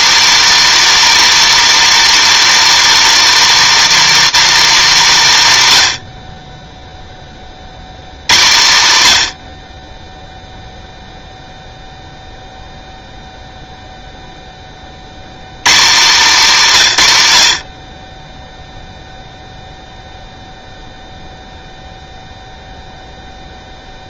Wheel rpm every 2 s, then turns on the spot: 330, 320, 270, 0, 120, 0, 0, 80, 130, 0, 0, 0.
none